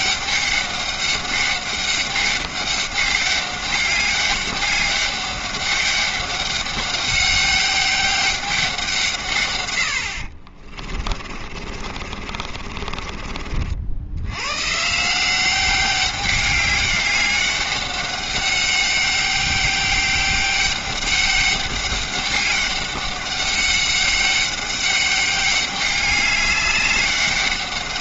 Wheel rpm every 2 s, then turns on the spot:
200, 200, 200, 200, 180, 50, 50, 130, 200, 200, 200, 200, 200, 200.
10-14